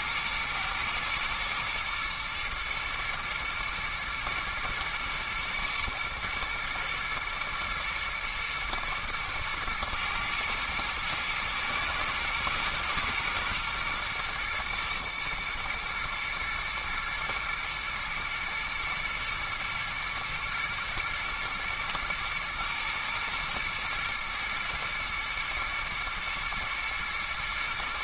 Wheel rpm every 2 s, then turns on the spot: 110, 110, 120, 110, 110, 110, 120, 110, 110, 110, 120, 120, 120, 120.
none